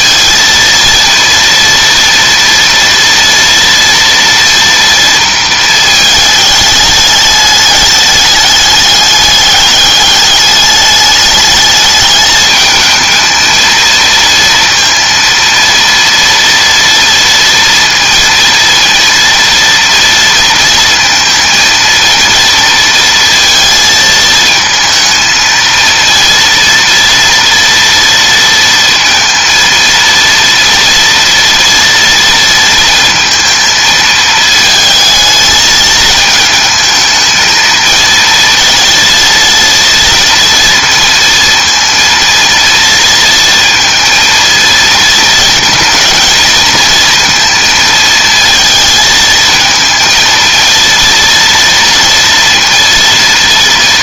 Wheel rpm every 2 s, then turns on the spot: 230, 230, 230, 210, 200, 200, 220, 230, 230, 230, 230, 230, 220, 230, 230, 230, 230, 220, 220, 230, 230, 230, 220, 220, 230, 230, 230.
none